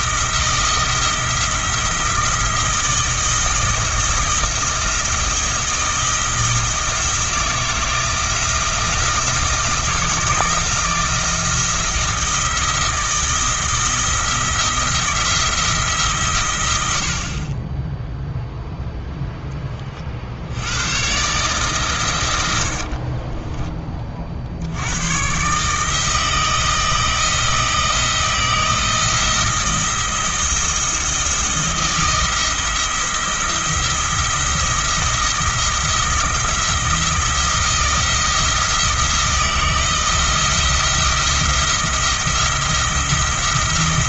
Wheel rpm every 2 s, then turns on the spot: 170, 170, 170, 160, 170, 170, 170, 170, 80, 0, 110, 60, 90, 160, 160, 170, 160, 170, 170, 170, 170, 160.
none